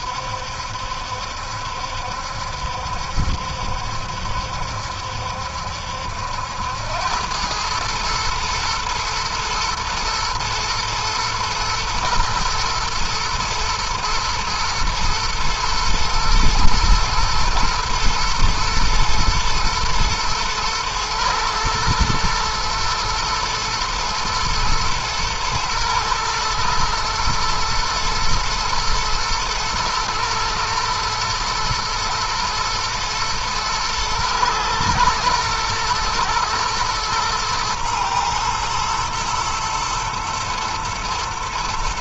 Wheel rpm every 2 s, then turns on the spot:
70, 70, 70, 90, 110, 120, 110, 110, 110, 110, 110, 120, 120, 110, 120, 120, 110, 110, 120, 120, 120.
none